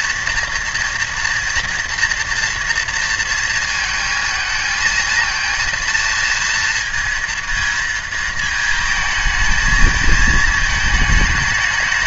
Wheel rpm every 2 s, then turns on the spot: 240, 230, 220, 230, 220, 220.
none